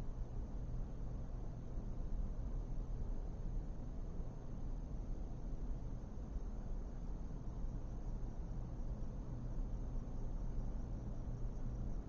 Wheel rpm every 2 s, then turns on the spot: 0, 0, 0, 0, 0, 0.
none